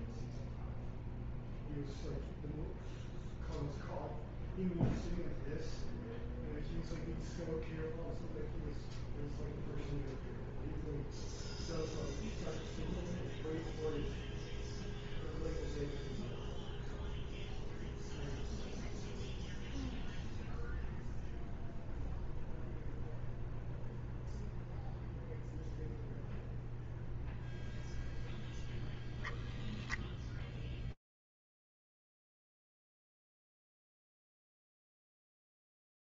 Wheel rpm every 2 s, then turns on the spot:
0, 0, 0, 0, 0, 0, 0, 0, 0, 0, 0, 0, 0, 0, 0, 0, 100, 80.
none